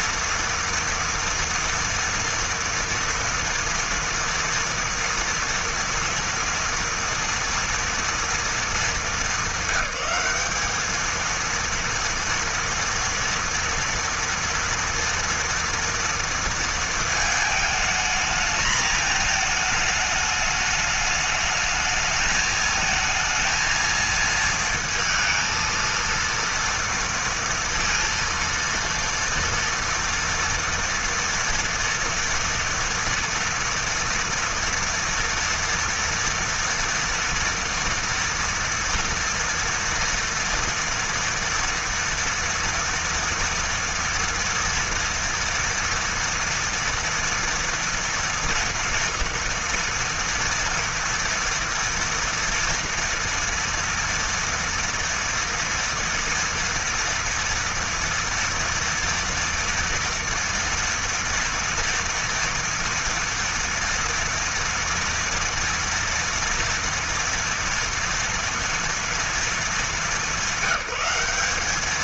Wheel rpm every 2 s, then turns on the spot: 230, 230, 230, 240, 200, 220, 230, 230, 220, 220, 210, 220, 230, 230, 230, 230, 230, 230, 230, 230, 230, 230, 230, 240, 230, 230, 230, 230, 230, 230, 230, 230, 230, 230, 220, 200.
none